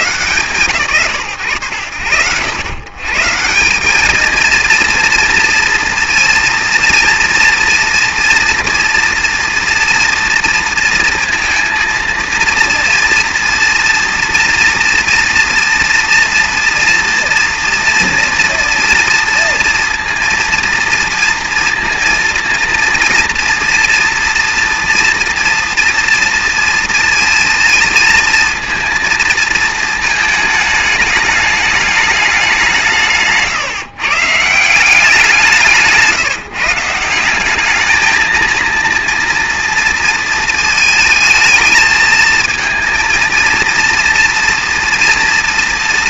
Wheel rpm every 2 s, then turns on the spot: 130, 100, 230, 230, 240, 230, 230, 230, 230, 230, 230, 230, 240, 230, 230, 220, 190, 170, 160, 230, 220, 230, 230.
none